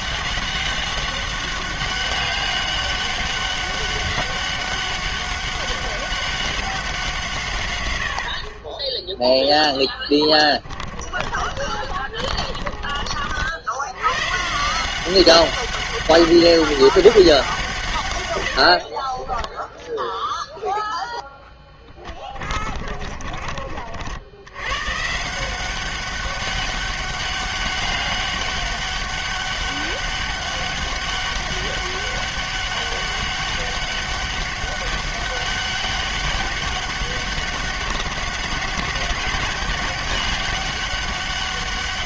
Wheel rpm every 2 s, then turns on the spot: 200, 200, 200, 180, 20, 30, 40, 170, 200, 60, 0, 30, 120, 200, 200, 200, 200, 200, 200, 190, 200.
10-14 18-20 22-24